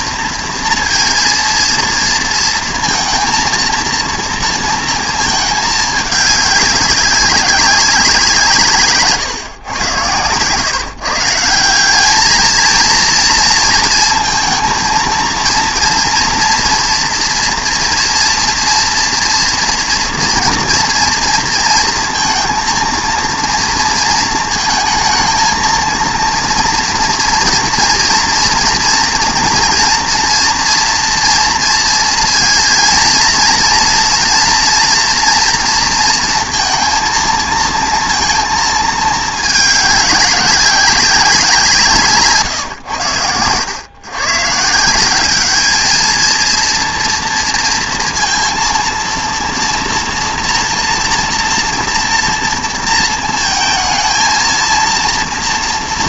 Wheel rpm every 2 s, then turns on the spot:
230, 230, 230, 200, 160, 130, 230, 230, 230, 230, 230, 230, 220, 240, 230, 230, 230, 240, 230, 220, 190, 130, 150, 230, 230, 230, 230, 230.
none